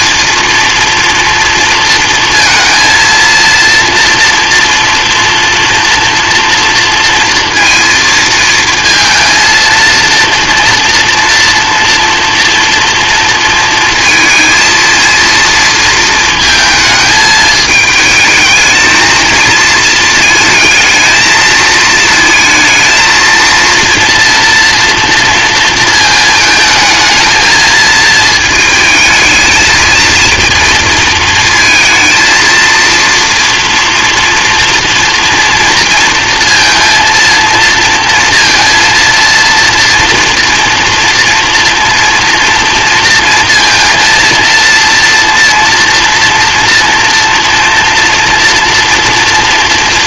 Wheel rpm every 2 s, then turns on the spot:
230, 230, 240, 230, 230, 230, 230, 230, 220, 220, 220, 230, 230, 220, 220, 230, 230, 230, 230, 230, 230, 230, 230, 230, 230.
none